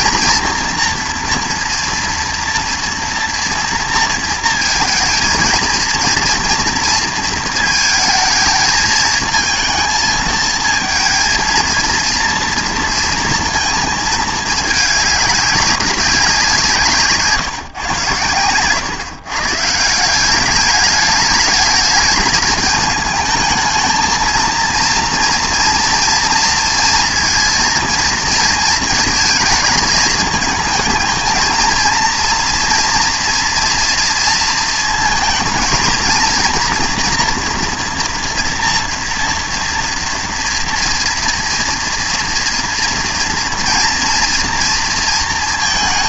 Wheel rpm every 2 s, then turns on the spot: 230, 230, 230, 230, 220, 220, 230, 210, 180, 120, 210, 220, 230, 230, 220, 220, 230, 220, 230, 230, 230, 240, 230.
none